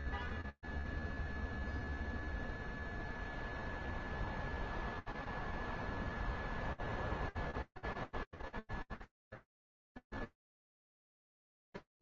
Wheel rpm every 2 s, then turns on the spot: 0, 0, 0, 0, 0, 0.
none